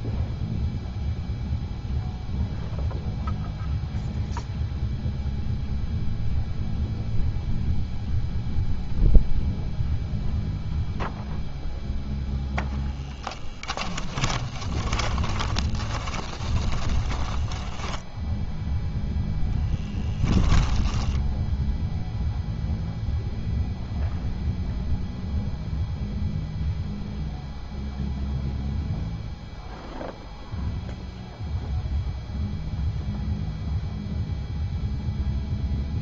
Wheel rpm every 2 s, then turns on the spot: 0, 0, 0, 0, 0, 0, 10, 20, 10, 0, 10, 0, 0, 0, 0, 0, 0, 0.
14-18 20-22